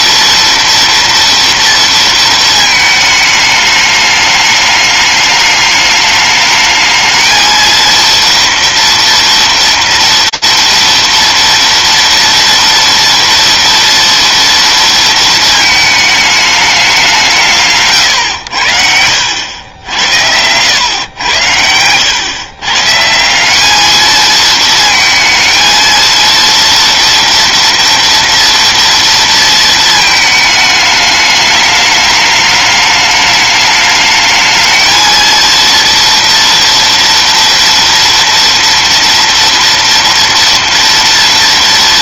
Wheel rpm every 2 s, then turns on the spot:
230, 220, 210, 220, 230, 230, 230, 230, 200, 90, 100, 170, 230, 230, 230, 210, 210, 230, 230, 230, 230.
18-20